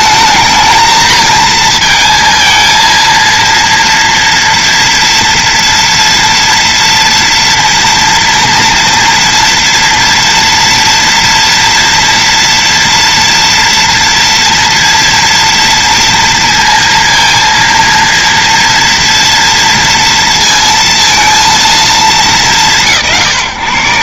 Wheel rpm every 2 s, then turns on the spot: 220, 230, 230, 230, 230, 230, 240, 230, 230, 230, 230, 170.
none